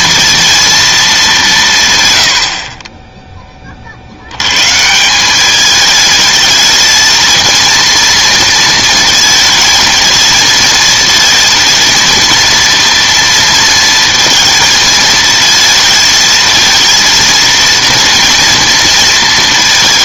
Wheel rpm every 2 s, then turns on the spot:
230, 50, 130, 220, 230, 220, 230, 230, 230, 230.
none